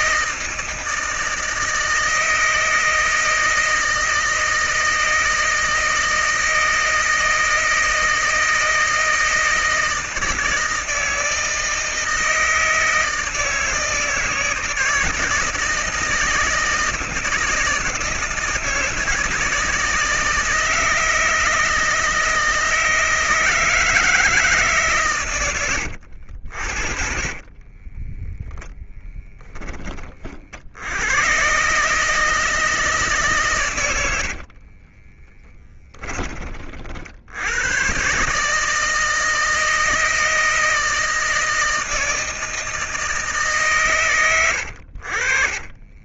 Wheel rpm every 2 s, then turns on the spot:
160, 160, 160, 160, 160, 160, 160, 160, 160, 160, 160, 160, 120, 40, 20, 110, 150, 20, 70, 160, 160, 160, 50.
26-28 34-36